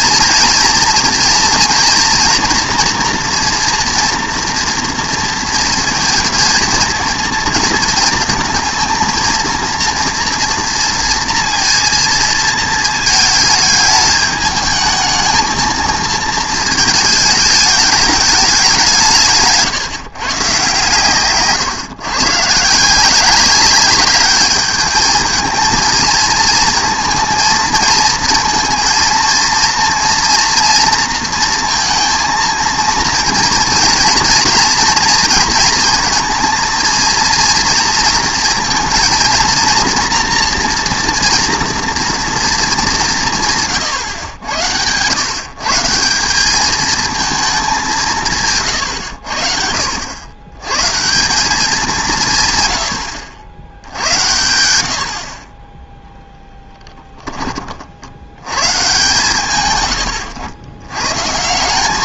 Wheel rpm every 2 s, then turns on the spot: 230, 240, 240, 220, 230, 230, 230, 220, 220, 190, 140, 160, 210, 230, 230, 230, 230, 230, 230, 230, 230, 220, 100, 210, 120, 110, 120, 90, 10, 120, 100.
none